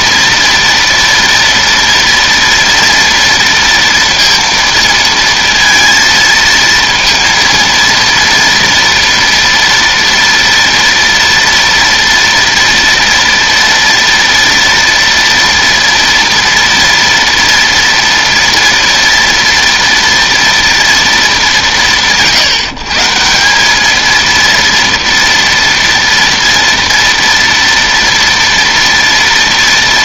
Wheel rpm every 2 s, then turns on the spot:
230, 240, 230, 230, 230, 230, 230, 230, 230, 230, 230, 160, 230, 230, 230.
none